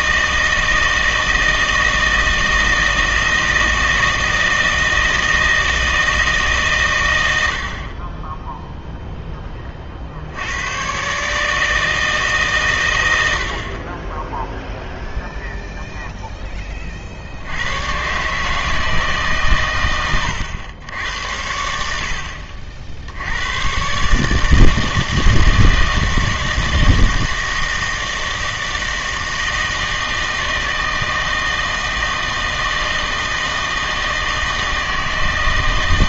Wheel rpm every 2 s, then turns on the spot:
160, 160, 160, 120, 0, 110, 130, 0, 30, 150, 90, 60, 160, 160, 160, 160, 160, 160.
none